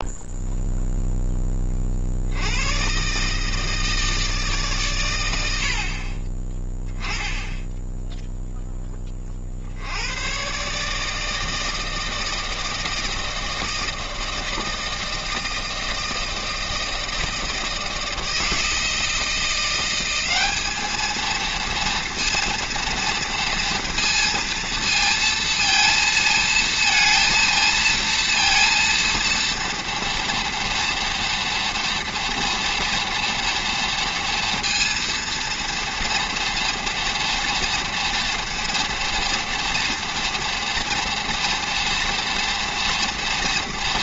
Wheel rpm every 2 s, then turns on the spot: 0, 120, 140, 10, 10, 150, 160, 160, 160, 160, 220, 230, 230, 230, 230, 230, 230, 230, 230, 230, 240, 230.
none